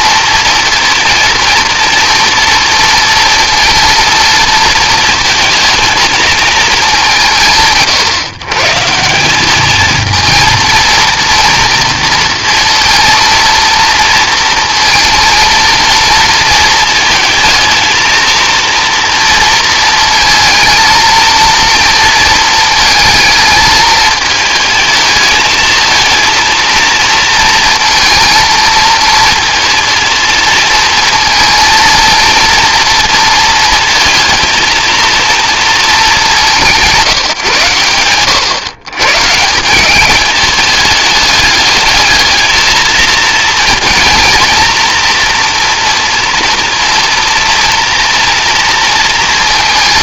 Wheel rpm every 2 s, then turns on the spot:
230, 230, 230, 200, 150, 230, 230, 230, 230, 230, 230, 220, 220, 230, 230, 230, 230, 230, 170, 130, 210, 230, 230, 230, 230.
none